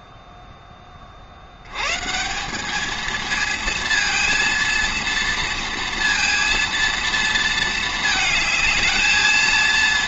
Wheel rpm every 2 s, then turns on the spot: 20, 200, 230, 230, 220.
none